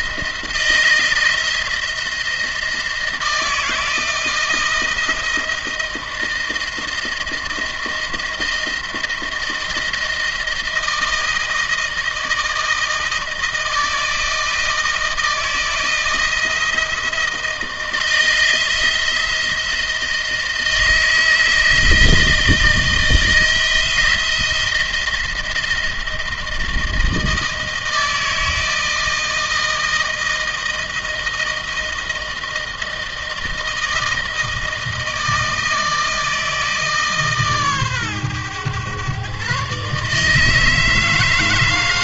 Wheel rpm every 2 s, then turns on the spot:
160, 170, 170, 160, 170, 160, 160, 160, 170, 170, 160, 160, 170, 160, 160, 160, 160, 160, 150, 120, 160.
none